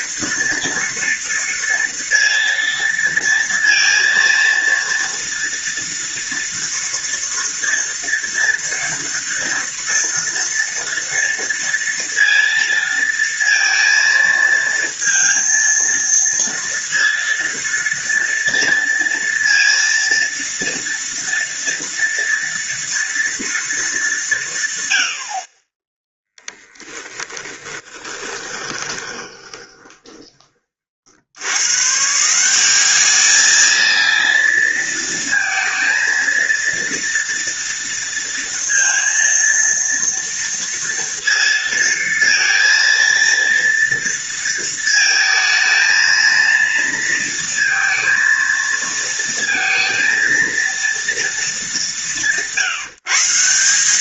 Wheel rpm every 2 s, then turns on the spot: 230, 230, 230, 230, 230, 230, 230, 230, 230, 230, 230, 230, 60, 10, 20, 80, 210, 230, 230, 230, 230, 230, 220, 230, 230, 210, 170.
26-30